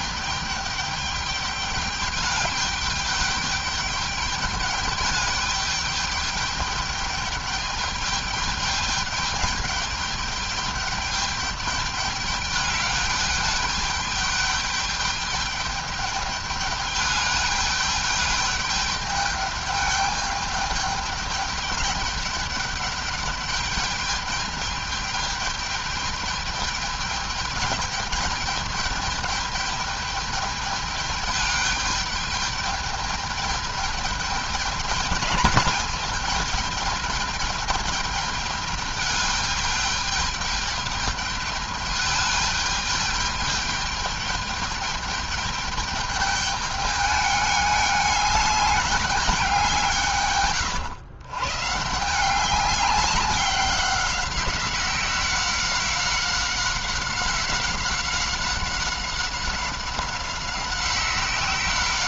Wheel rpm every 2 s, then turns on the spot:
210, 210, 210, 210, 210, 210, 210, 210, 210, 210, 210, 200, 210, 210, 210, 210, 210, 210, 210, 210, 210, 210, 210, 210, 210, 130, 200, 190, 190, 190, 190.
none